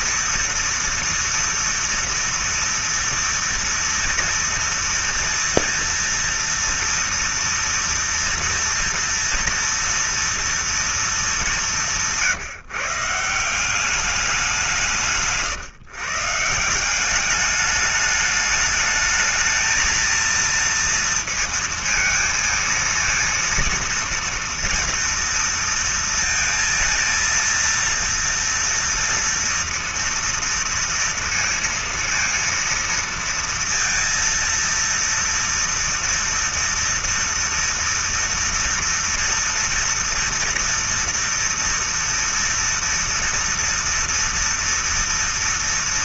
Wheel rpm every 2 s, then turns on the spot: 230, 230, 230, 230, 230, 230, 170, 200, 140, 210, 220, 230, 230, 230, 230, 230, 230, 230, 230, 230, 230, 230, 230.
none